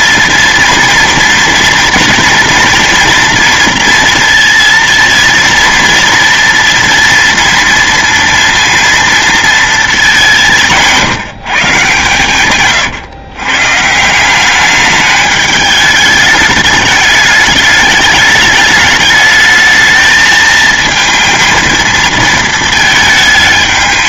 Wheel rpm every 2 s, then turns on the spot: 230, 230, 230, 230, 230, 170, 140, 200, 210, 220, 220, 220.
none